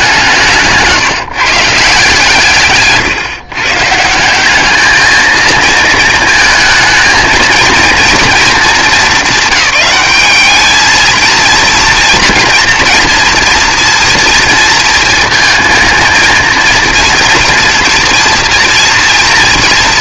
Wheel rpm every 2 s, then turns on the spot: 170, 150, 210, 230, 220, 210, 230, 230, 230, 230.
none